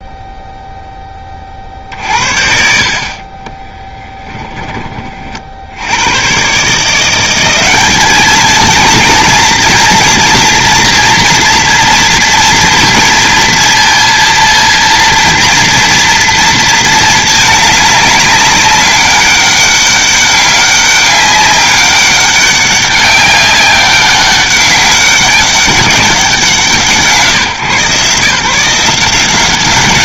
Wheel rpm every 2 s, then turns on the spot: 0, 60, 20, 140, 230, 240, 230, 230, 230, 200, 200, 190, 190, 160, 160.
none